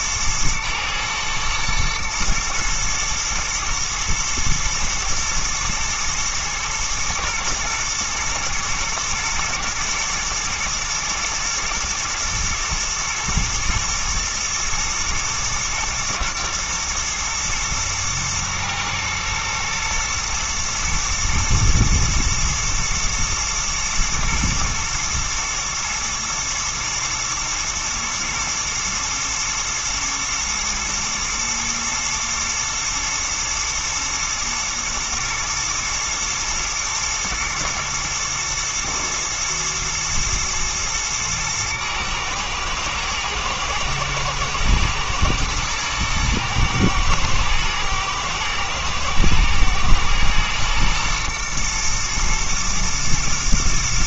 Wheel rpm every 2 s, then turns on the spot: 120, 110, 110, 110, 110, 110, 110, 110, 120, 120, 110, 120, 120, 120, 120, 110, 110, 110, 110, 110, 110, 110, 110, 110, 110, 110, 110.
none